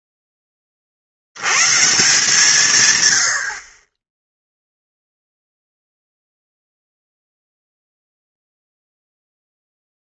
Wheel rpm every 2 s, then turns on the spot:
20, 160, 0, 0, 0.
none